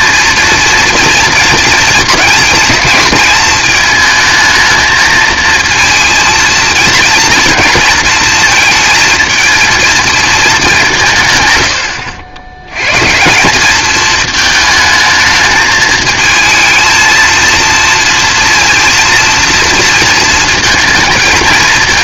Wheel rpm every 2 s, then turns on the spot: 230, 220, 220, 230, 220, 210, 100, 220, 220, 230, 220.
none